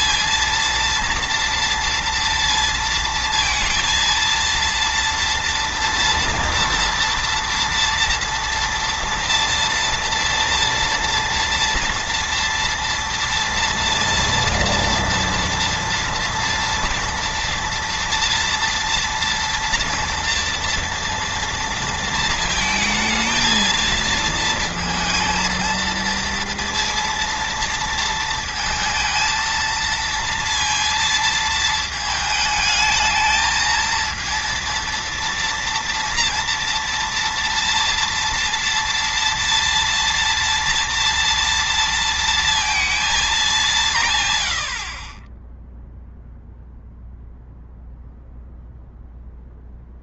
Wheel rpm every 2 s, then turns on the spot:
230, 230, 230, 230, 230, 230, 230, 230, 230, 230, 230, 230, 230, 230, 230, 230, 220, 230, 230, 230, 230, 230, 50, 0, 0.
none